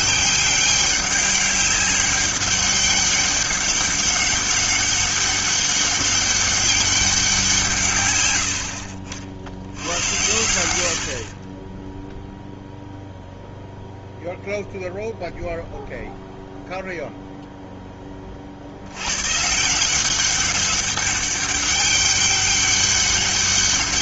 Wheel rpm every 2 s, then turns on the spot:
200, 200, 200, 200, 90, 80, 0, 0, 0, 60, 190, 200.
8-10